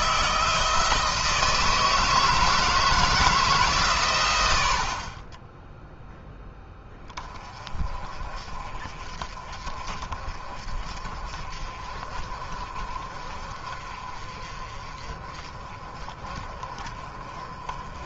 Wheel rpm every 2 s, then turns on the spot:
160, 160, 70, 10, 40, 40, 40, 40, 30.
none